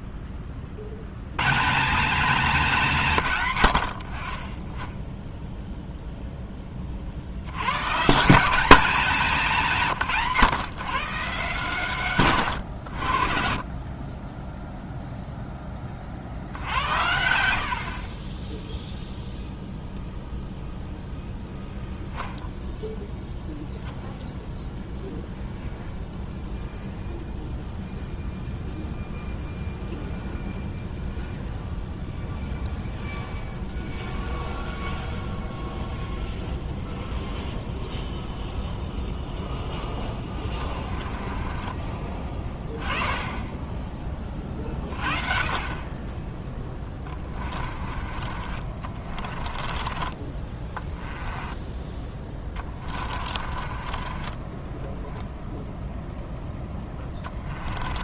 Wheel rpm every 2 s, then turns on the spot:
40, 180, 10, 20, 200, 140, 100, 0, 80, 0, 0, 0, 0, 0, 0, 0, 0, 0, 0, 0, 20, 10, 30, 10, 40, 20, 30, 10, 10.
40-42 46-58